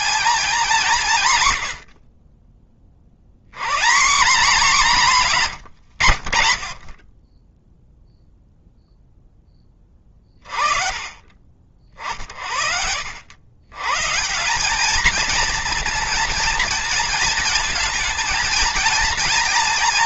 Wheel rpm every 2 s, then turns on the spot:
190, 40, 210, 30, 0, 40, 70, 190, 230, 230.
none